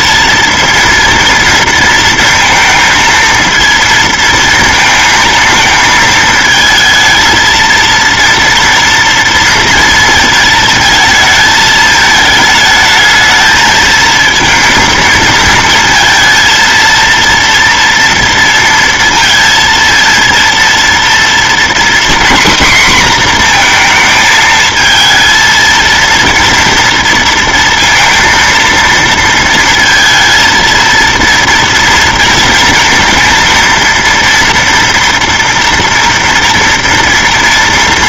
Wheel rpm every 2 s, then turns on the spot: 230, 230, 230, 220, 230, 220, 210, 230, 230, 230, 230, 250, 220, 230, 230, 230, 230, 230, 230.
none